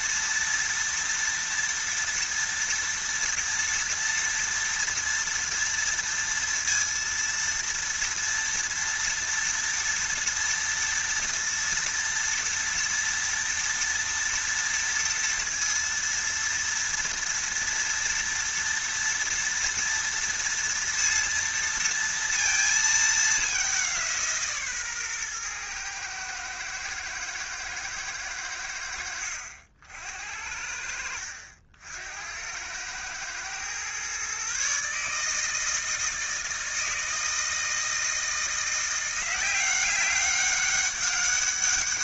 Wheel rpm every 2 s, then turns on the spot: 240, 230, 240, 230, 230, 230, 230, 230, 230, 230, 230, 220, 140, 110, 80, 70, 100, 150, 160, 170, 200.
none